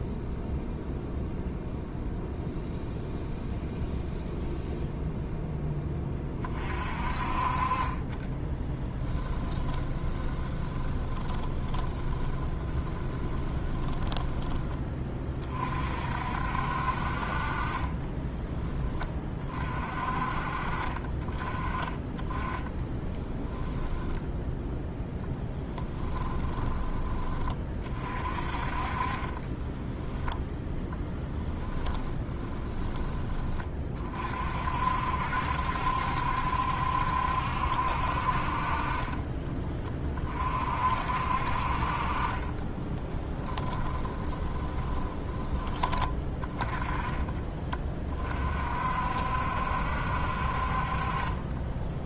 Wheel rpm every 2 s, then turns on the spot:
0, 0, 0, 40, 20, 20, 30, 20, 60, 10, 40, 20, 0, 10, 30, 0, 20, 50, 70, 40, 50, 30, 20, 20, 50, 50.
8-14 22-24 42-46